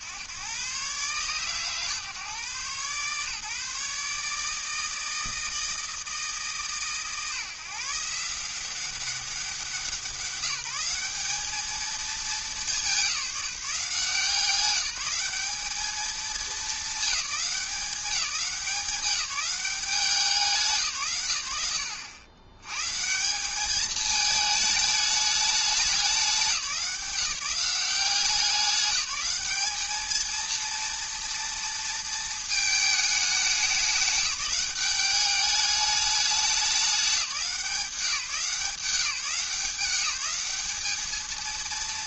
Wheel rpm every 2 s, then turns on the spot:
130, 130, 160, 150, 180, 180, 200, 180, 210, 190, 150, 120, 210, 180, 190, 230, 220, 200, 200, 170, 210.
none